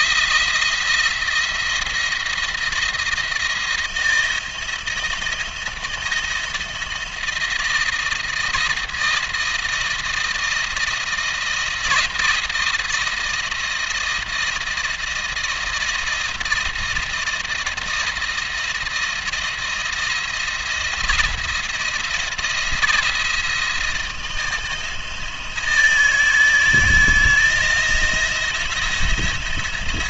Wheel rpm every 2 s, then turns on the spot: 170, 170, 170, 170, 170, 170, 170, 160, 170, 160, 170, 170, 160, 160, 170.
none